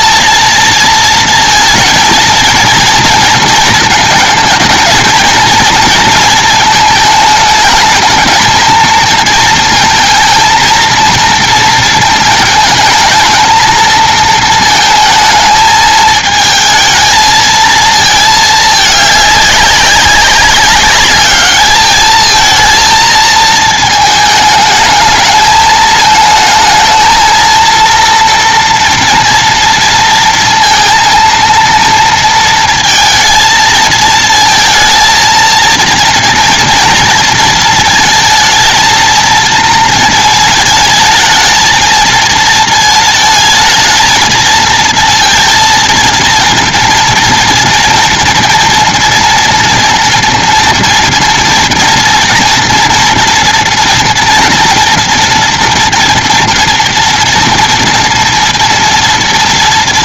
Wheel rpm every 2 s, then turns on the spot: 230, 230, 230, 220, 220, 230, 220, 220, 220, 210, 200, 230, 220, 220, 230, 230, 230, 220, 230, 230, 220, 220, 230, 230, 240, 240, 240, 230, 230, 230.
none